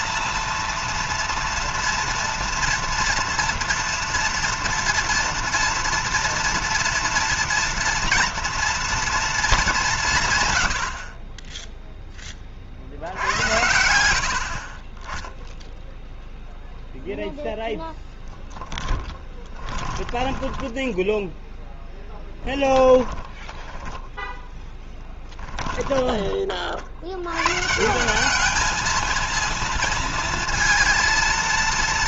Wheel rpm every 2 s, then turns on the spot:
230, 240, 230, 230, 230, 60, 60, 30, 0, 10, 10, 10, 10, 70, 220, 230.
18-20 22-26